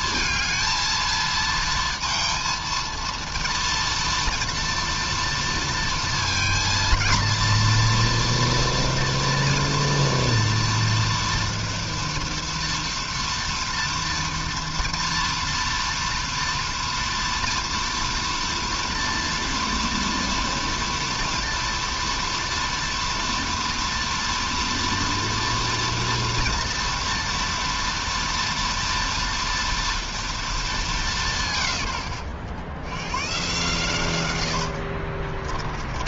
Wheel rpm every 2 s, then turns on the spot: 230, 230, 230, 230, 230, 230, 230, 230, 230, 230, 230, 230, 230, 230, 230, 130, 110, 30.
34-36